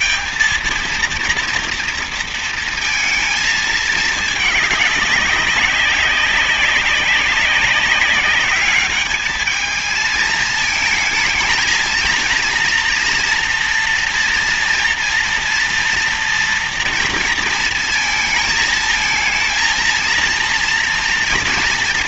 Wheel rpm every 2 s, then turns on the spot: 230, 230, 210, 190, 210, 220, 230, 230, 240, 220, 230.
none